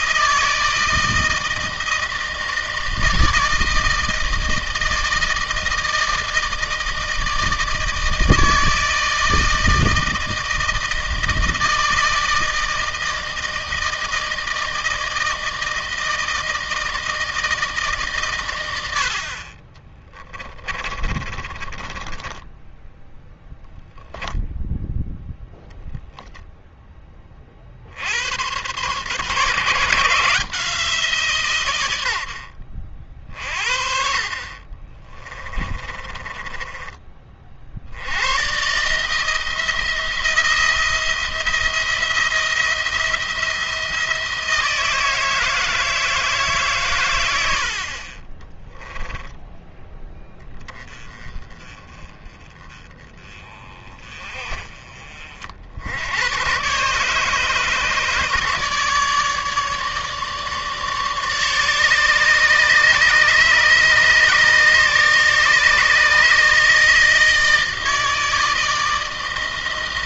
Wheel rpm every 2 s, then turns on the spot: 160, 160, 160, 160, 160, 160, 160, 160, 160, 90, 30, 10, 0, 10, 120, 160, 50, 30, 20, 140, 170, 170, 160, 130, 20, 20, 20, 40, 130, 150, 150, 150, 150, 150, 160.
20-24 34-36 48-50